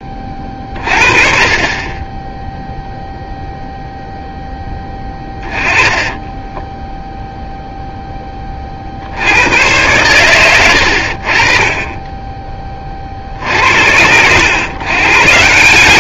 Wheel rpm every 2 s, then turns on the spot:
30, 0, 10, 10, 40, 100, 30, 110.
4-8